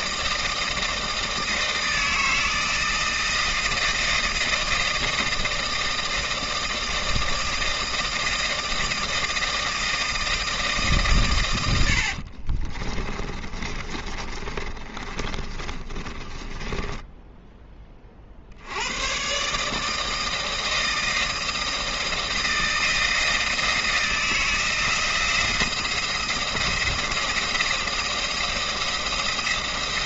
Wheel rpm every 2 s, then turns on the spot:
160, 160, 160, 160, 160, 160, 30, 30, 10, 90, 160, 160, 160, 170, 170.
12-18